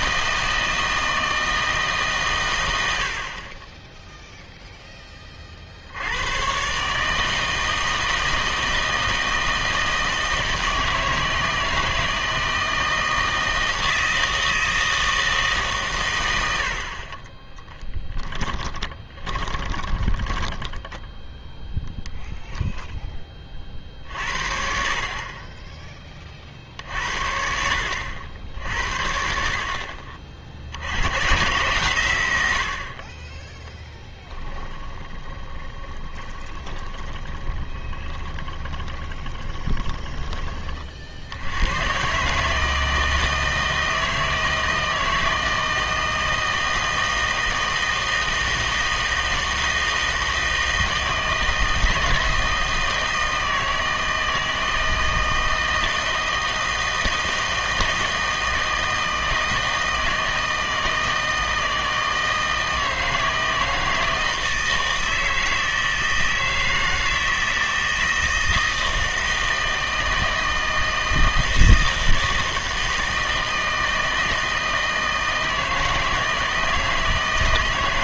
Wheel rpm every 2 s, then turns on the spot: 160, 120, 0, 120, 160, 160, 160, 160, 70, 20, 10, 0, 50, 50, 70, 60, 70, 10, 20, 20, 30, 150, 160, 160, 160, 160, 160, 160, 160, 160, 160, 160, 160, 160, 160, 160, 160, 160, 160.
18-22 34-40